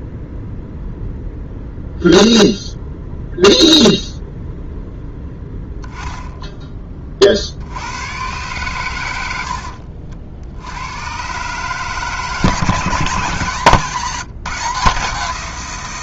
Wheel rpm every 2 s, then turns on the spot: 0, 0, 0, 10, 110, 90, 160, 160.
none